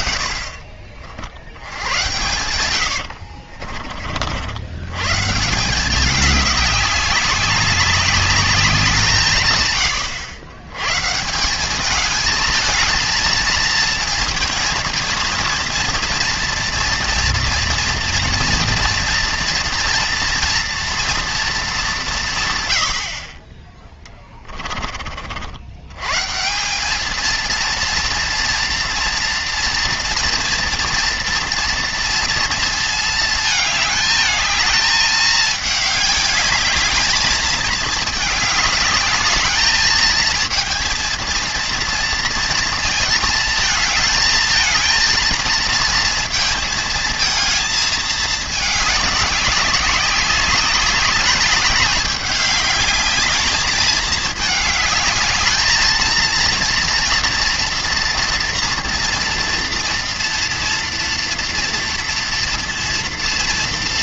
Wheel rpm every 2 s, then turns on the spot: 40, 80, 100, 200, 190, 120, 220, 220, 230, 230, 230, 100, 30, 190, 230, 230, 230, 220, 210, 210, 220, 220, 220, 230, 210, 200, 210, 210, 230, 230, 230, 230.
2-4